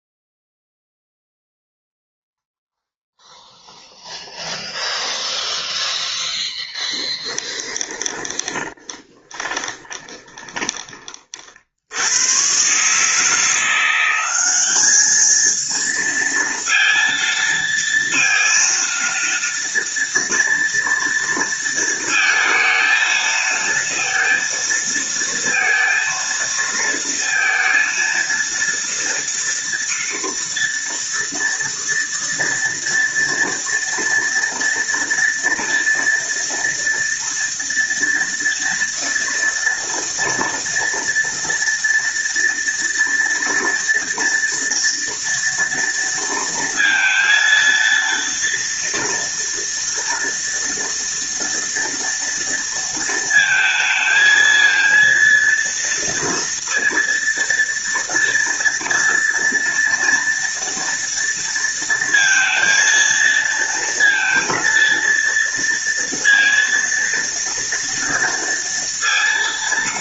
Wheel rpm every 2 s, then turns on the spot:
0, 0, 0, 10, 20, 30, 150, 210, 230, 230, 230, 230, 230, 230, 230, 230, 230, 230, 230, 230, 240, 230, 230, 230, 230, 230, 230, 230, 230, 230, 230, 230, 230, 230, 230.
6-10